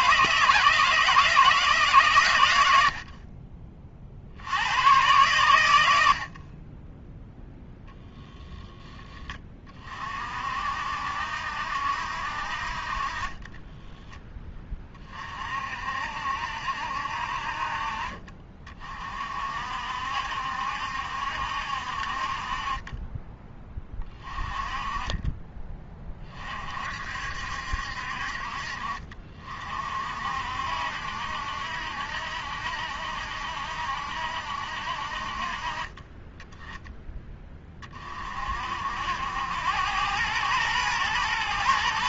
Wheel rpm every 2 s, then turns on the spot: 160, 70, 110, 10, 10, 60, 50, 30, 60, 40, 70, 30, 20, 50, 50, 70, 70, 60, 20, 70, 110.
none